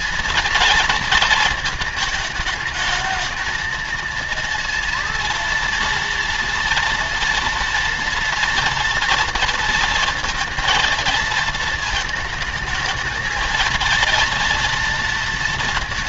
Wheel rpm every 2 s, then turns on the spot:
220, 210, 230, 230, 230, 230, 220, 230.
none